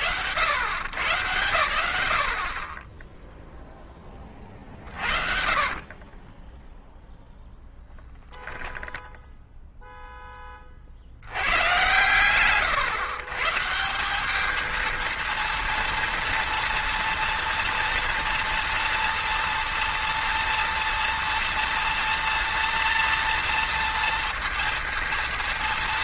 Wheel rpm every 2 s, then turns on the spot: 100, 10, 50, 0, 0, 80, 140, 230, 230, 230, 230, 240, 230.
4-6